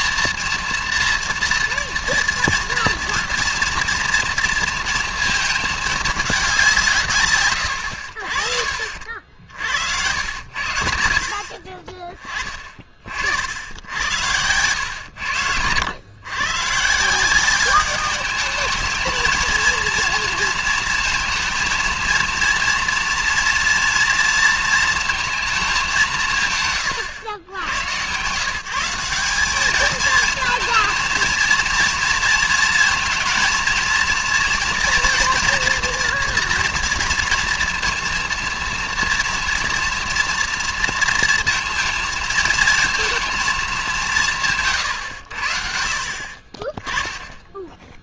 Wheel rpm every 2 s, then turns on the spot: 240, 230, 230, 180, 50, 80, 30, 100, 140, 210, 230, 230, 230, 130, 160, 220, 230, 240, 240, 230, 230, 230, 150, 20.
none